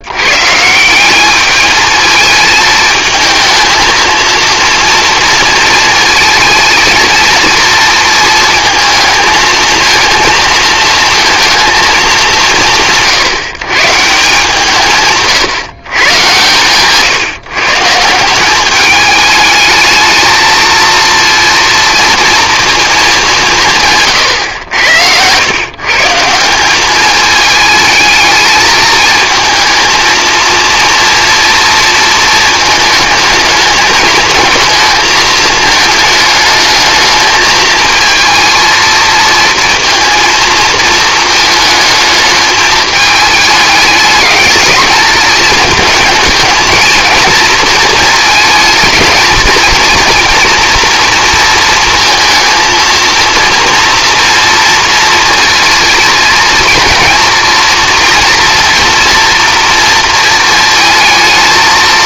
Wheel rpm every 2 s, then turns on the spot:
160, 220, 230, 230, 220, 230, 160, 150, 130, 200, 230, 220, 100, 190, 220, 230, 220, 220, 210, 220, 220, 220, 210, 220, 220, 230, 230, 230, 230, 230, 220.
24-26